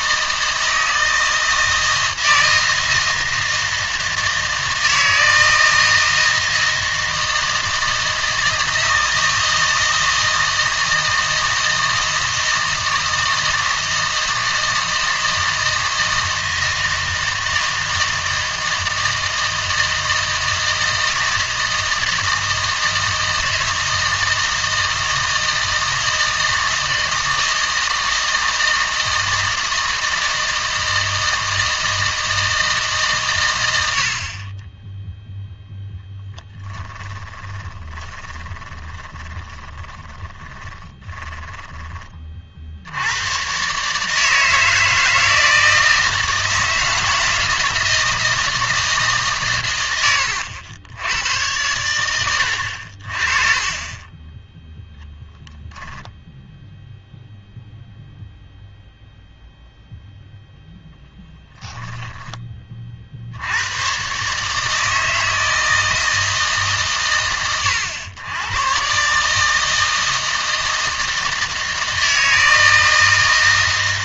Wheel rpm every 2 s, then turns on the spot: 160, 160, 160, 160, 160, 160, 160, 160, 160, 160, 160, 160, 160, 160, 160, 160, 160, 20, 10, 20, 10, 60, 160, 160, 160, 90, 60, 0, 0, 0, 0, 30, 160, 120, 120, 160, 160.
36-42